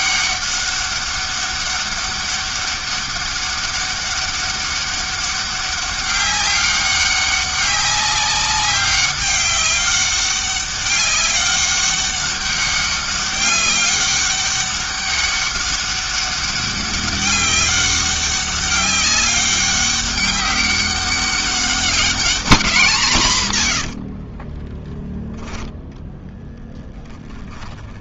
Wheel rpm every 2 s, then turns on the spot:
200, 200, 200, 200, 190, 200, 200, 200, 200, 200, 200, 190, 10, 10.
26-28